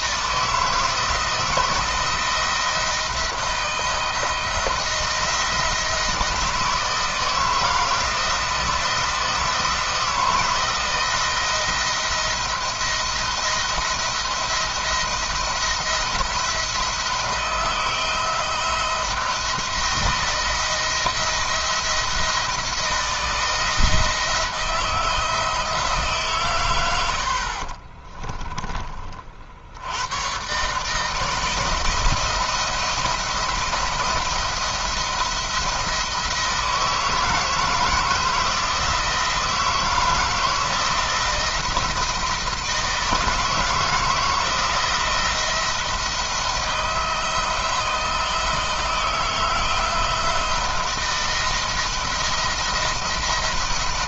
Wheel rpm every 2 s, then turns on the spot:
160, 170, 170, 160, 170, 170, 170, 170, 170, 160, 170, 170, 170, 80, 30, 140, 170, 170, 160, 160, 160, 160, 170, 170, 160, 160, 170.
none